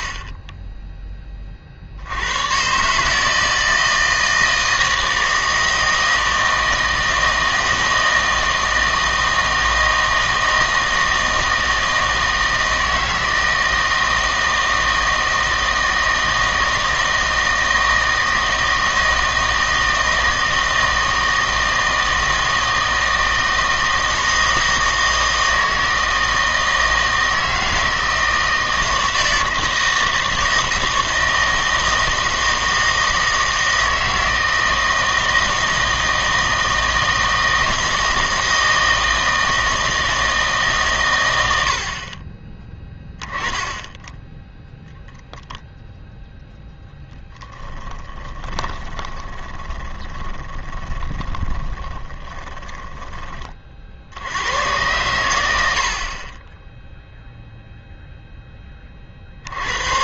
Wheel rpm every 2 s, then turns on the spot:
10, 130, 160, 160, 160, 160, 160, 160, 160, 160, 160, 160, 160, 160, 160, 160, 160, 160, 160, 160, 140, 10, 10, 0, 20, 20, 10, 110, 10, 20.
48-54